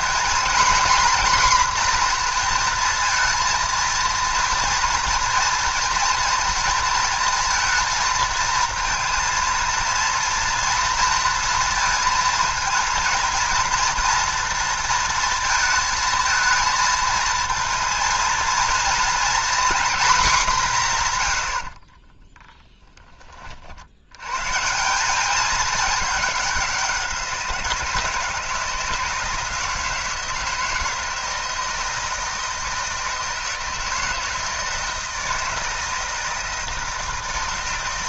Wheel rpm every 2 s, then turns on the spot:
250, 230, 230, 230, 230, 230, 230, 230, 230, 230, 180, 10, 160, 190, 160, 160, 160, 160, 160.
none